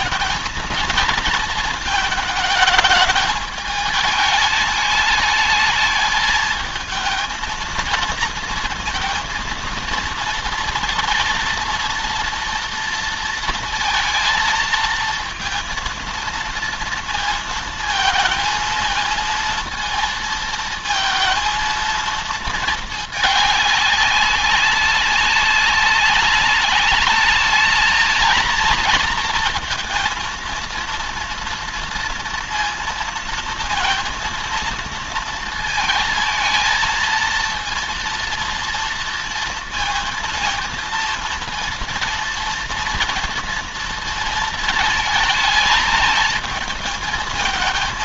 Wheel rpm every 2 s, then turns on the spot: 220, 220, 210, 220, 230, 230, 230, 230, 230, 230, 220, 220, 200, 200, 220, 230, 230, 230, 230, 230, 230, 230, 230, 220.
none